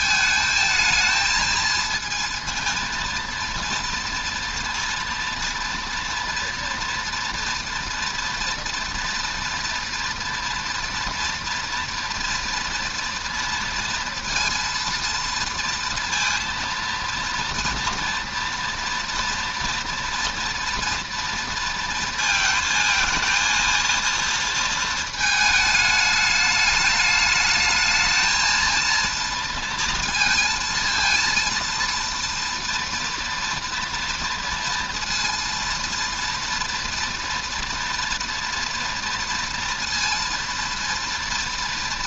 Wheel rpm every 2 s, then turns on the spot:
220, 230, 240, 240, 230, 230, 230, 230, 230, 230, 230, 220, 230, 210, 230, 230, 230, 230, 230, 230, 230.
none